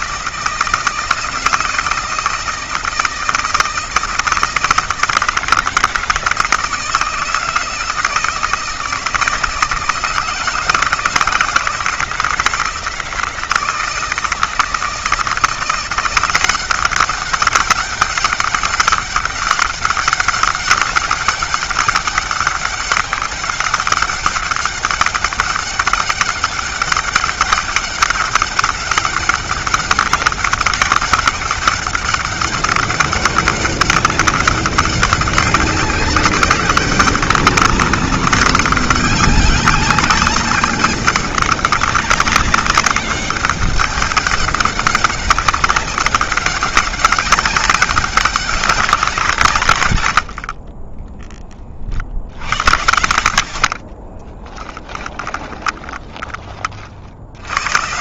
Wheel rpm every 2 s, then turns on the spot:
160, 160, 170, 160, 160, 160, 160, 170, 190, 200, 190, 200, 200, 200, 200, 200, 200, 200, 200, 200, 200, 200, 200, 200, 160, 20, 70, 20, 60.
50-52 54-56